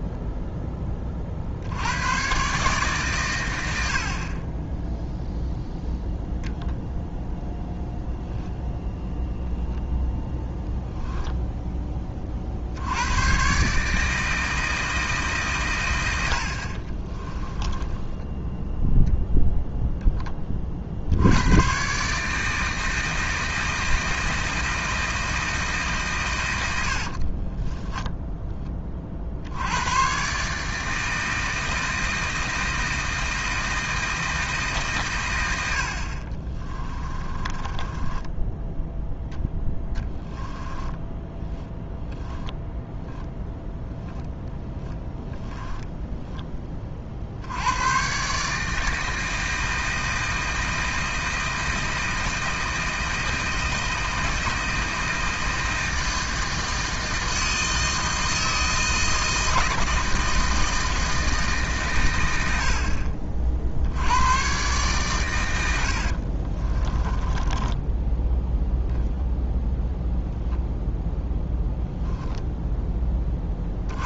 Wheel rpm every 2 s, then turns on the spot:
20, 140, 0, 0, 0, 0, 80, 160, 40, 0, 50, 160, 160, 90, 30, 160, 160, 140, 20, 0, 10, 10, 20, 40, 160, 160, 160, 160, 160, 160, 160, 70, 120, 20, 0, 0, 10.
16-18 26-28 36-38 40-42 44-46 66-68